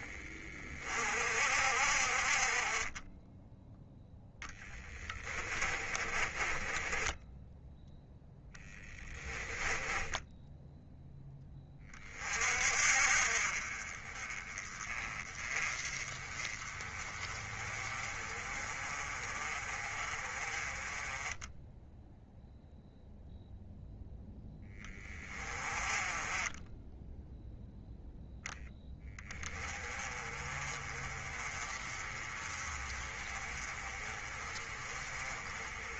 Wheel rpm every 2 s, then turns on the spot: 50, 30, 10, 20, 10, 0, 40, 20, 30, 30, 20, 0, 10, 10, 10, 30, 30, 30.
4-10